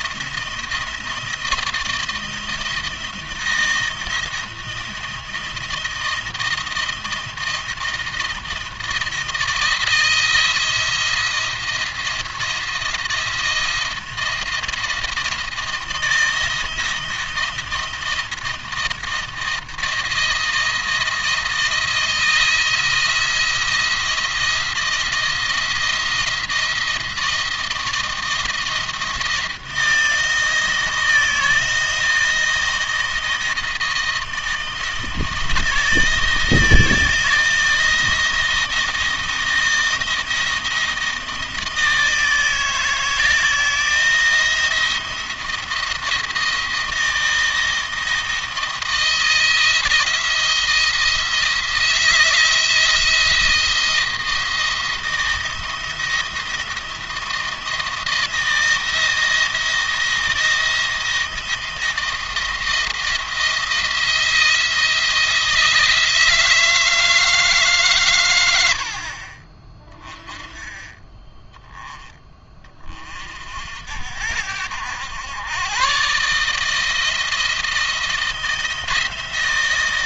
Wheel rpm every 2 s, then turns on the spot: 170, 160, 160, 170, 170, 170, 170, 170, 170, 160, 160, 160, 170, 170, 160, 160, 160, 160, 160, 170, 160, 160, 170, 170, 160, 170, 170, 160, 170, 160, 170, 170, 170, 160, 80, 30, 30, 80, 150, 160.
none